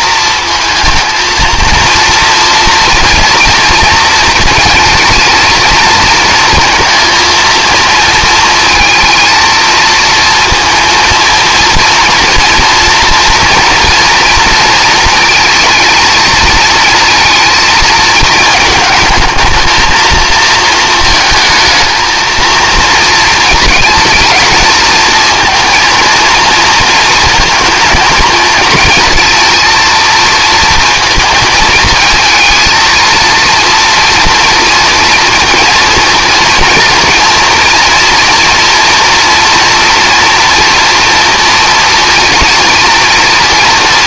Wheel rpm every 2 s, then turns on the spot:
230, 230, 230, 230, 220, 230, 240, 230, 220, 220, 220, 230, 220, 230, 220, 230, 220, 230, 230, 230, 230, 230.
none